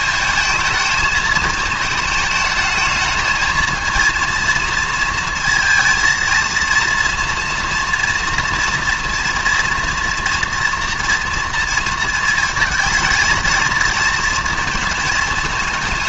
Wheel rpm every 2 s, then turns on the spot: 220, 220, 230, 230, 230, 230, 220, 230.
none